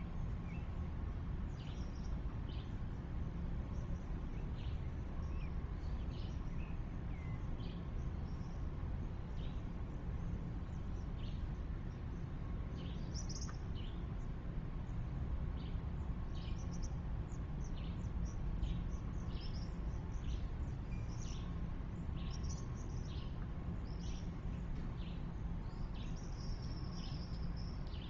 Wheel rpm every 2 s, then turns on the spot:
0, 0, 0, 0, 0, 0, 0, 0, 0, 0, 0, 0, 0, 0.
none